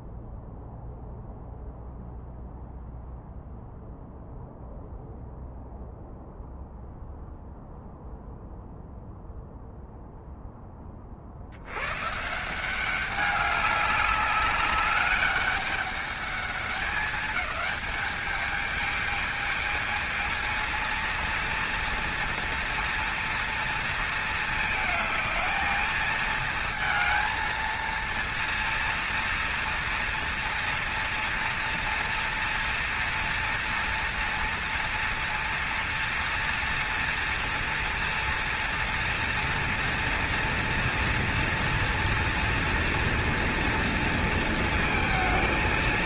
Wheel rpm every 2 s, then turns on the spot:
0, 0, 0, 0, 0, 30, 190, 200, 200, 220, 230, 230, 220, 230, 230, 230, 230, 230, 230, 230, 230, 230, 220.
none